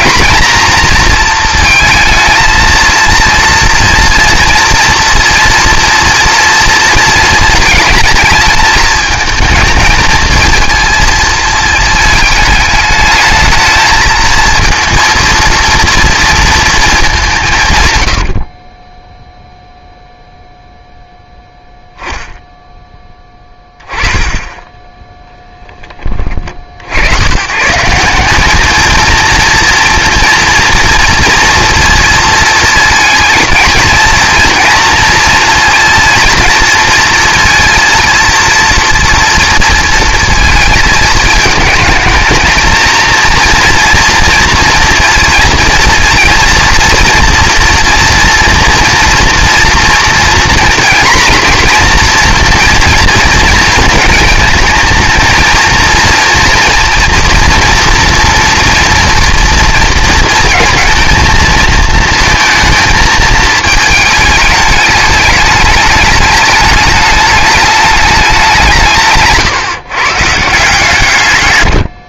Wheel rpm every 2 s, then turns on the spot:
230, 230, 230, 230, 220, 230, 210, 230, 230, 30, 0, 0, 10, 50, 210, 230, 220, 230, 230, 230, 220, 220, 230, 230, 230, 240, 230, 230, 240, 230, 230, 220, 210, 210, 180, 150.
none